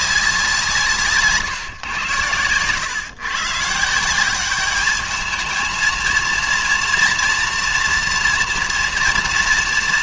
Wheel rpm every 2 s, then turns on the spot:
170, 120, 200, 230, 230.
none